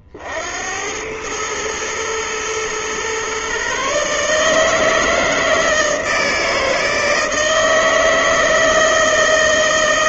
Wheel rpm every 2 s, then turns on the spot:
100, 120, 160, 160, 160.
none